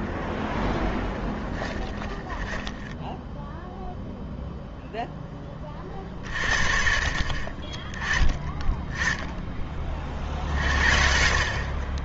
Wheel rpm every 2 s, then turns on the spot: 10, 10, 0, 50, 30, 60.
0-4